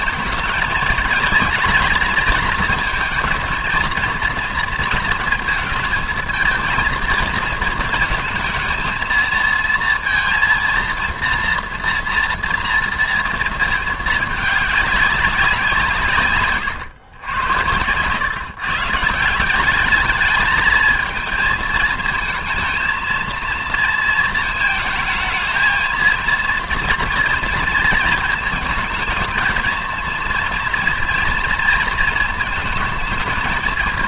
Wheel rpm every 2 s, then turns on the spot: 210, 220, 230, 220, 230, 230, 230, 200, 130, 140, 210, 220, 220, 230, 220, 240, 220.
none